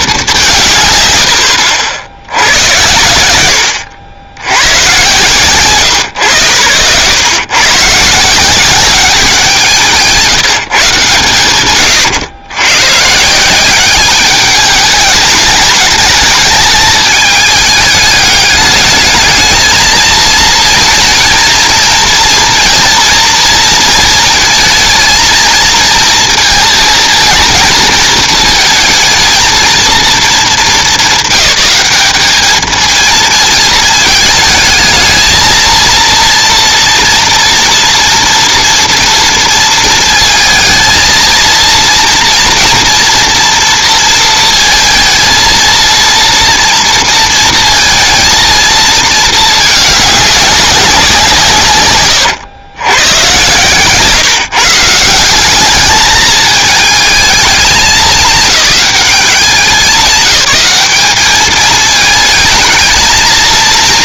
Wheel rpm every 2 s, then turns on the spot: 150, 90, 130, 100, 180, 160, 120, 210, 210, 210, 230, 230, 220, 230, 220, 200, 220, 220, 230, 230, 230, 230, 230, 230, 230, 200, 120, 160, 220, 210, 210, 220.
none